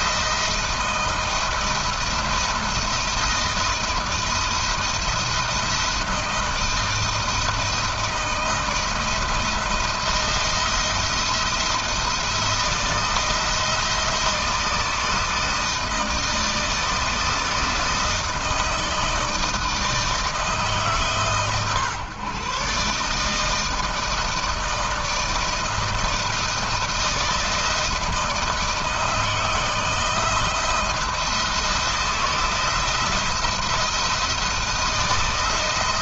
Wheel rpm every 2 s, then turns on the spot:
170, 170, 170, 160, 160, 170, 170, 160, 160, 160, 140, 150, 160, 160, 160, 170, 170, 160.
none